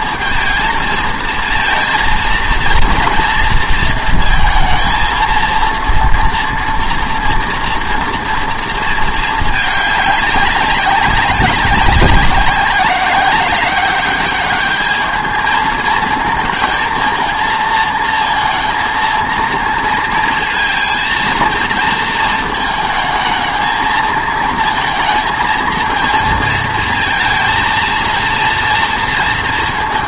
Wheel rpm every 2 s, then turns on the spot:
220, 230, 230, 230, 230, 190, 190, 210, 220, 230, 230, 220, 220, 220, 230.
none